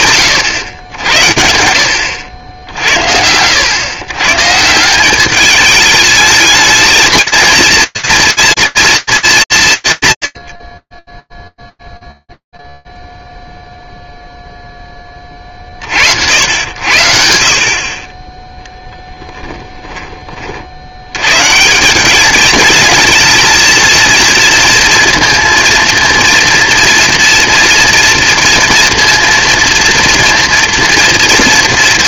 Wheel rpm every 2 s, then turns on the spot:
100, 70, 160, 220, 230, 20, 0, 10, 80, 10, 70, 220, 230, 230, 230, 230.
none